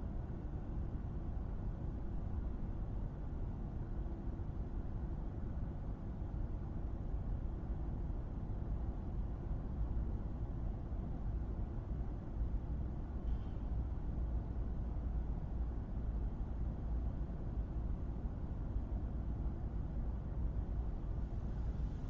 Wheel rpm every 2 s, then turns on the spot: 0, 0, 0, 0, 0, 0, 0, 0, 0, 0, 0.
none